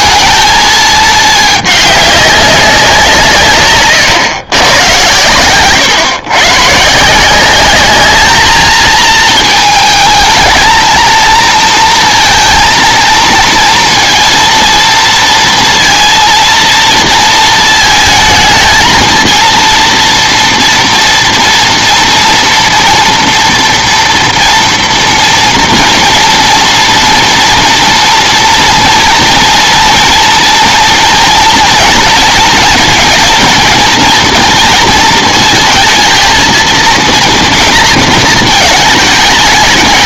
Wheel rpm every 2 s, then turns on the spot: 220, 190, 110, 130, 220, 220, 230, 230, 230, 220, 230, 230, 240, 230, 230, 240, 220, 230, 230, 220.
none